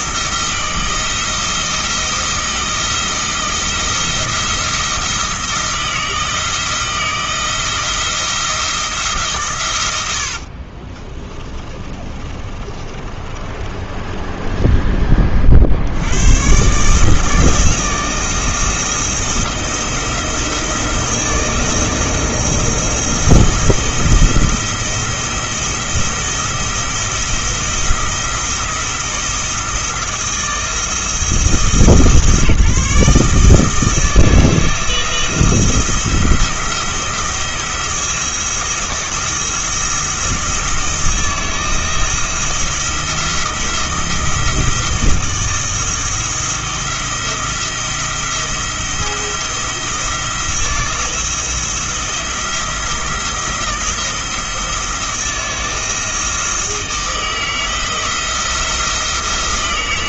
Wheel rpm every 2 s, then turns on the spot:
160, 160, 170, 160, 160, 30, 30, 20, 140, 170, 170, 170, 170, 170, 170, 160, 150, 160, 170, 170, 170, 170, 160, 170, 170, 170, 170, 170, 160, 170.
10-16